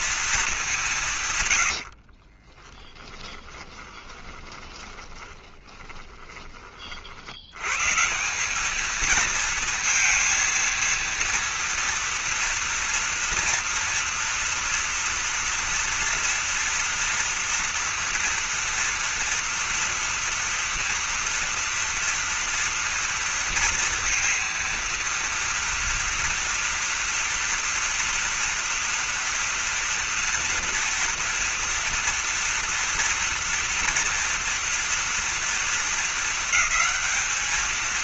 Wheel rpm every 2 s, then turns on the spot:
210, 30, 10, 30, 210, 230, 230, 230, 230, 230, 230, 230, 230, 230, 230, 230, 230, 230, 210.
2-6